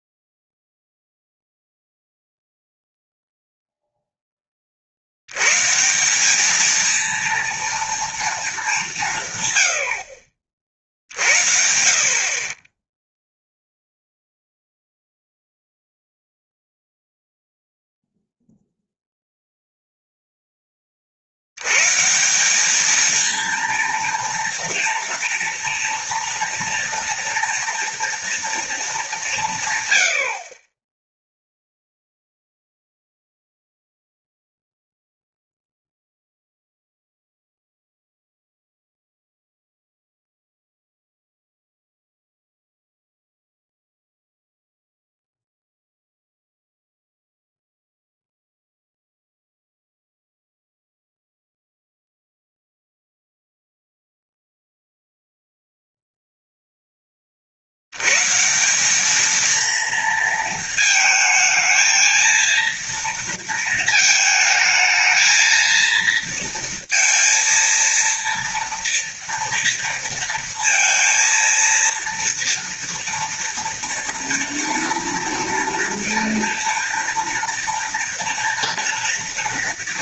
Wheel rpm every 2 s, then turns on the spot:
0, 0, 20, 210, 220, 50, 40, 0, 0, 0, 10, 190, 230, 230, 230, 50, 0, 0, 0, 0, 0, 0, 0, 0, 0, 0, 0, 0, 0, 160, 230, 230, 220, 230, 230, 230, 230, 230, 240, 240.
none